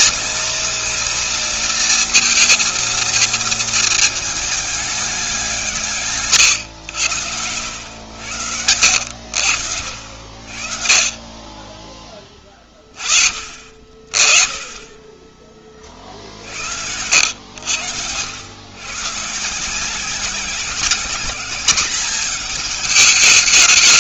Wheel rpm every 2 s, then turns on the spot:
240, 230, 210, 120, 90, 60, 20, 30, 60, 110, 190, 210.
none